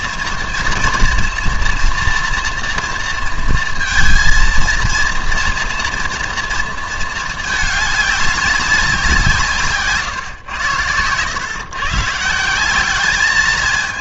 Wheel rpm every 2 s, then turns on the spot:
230, 240, 230, 230, 200, 120, 180.
none